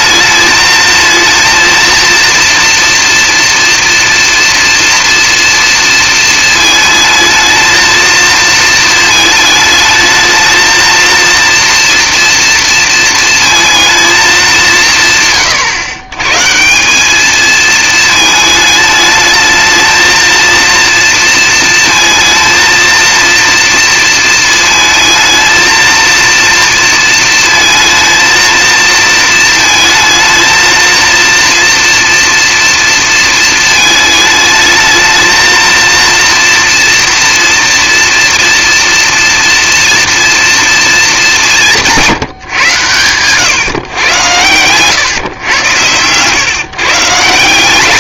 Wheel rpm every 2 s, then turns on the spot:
220, 230, 230, 220, 230, 220, 230, 180, 170, 220, 230, 230, 220, 230, 230, 230, 230, 210, 230, 230, 230, 130, 120, 140.
none